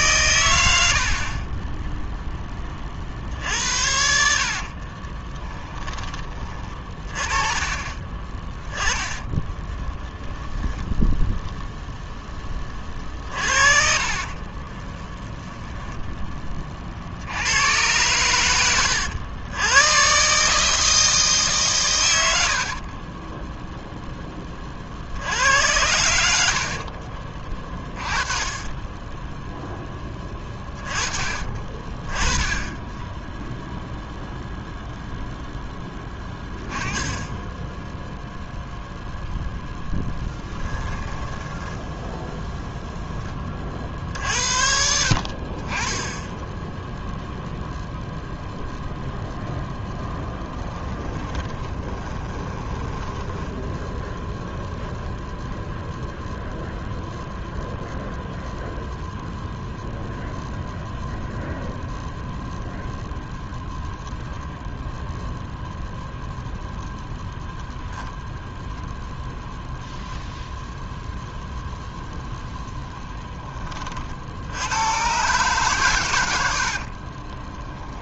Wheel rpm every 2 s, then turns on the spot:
100, 20, 50, 30, 20, 10, 20, 40, 30, 100, 150, 80, 30, 60, 20, 20, 10, 0, 10, 0, 10, 0, 50, 10, 0, 10, 20, 10, 0, 0, 0, 0, 0, 0, 0, 0, 10, 90, 70.
4-6 8-10 14-16 18-20 22-24 26-28 40-42 50-54 76-78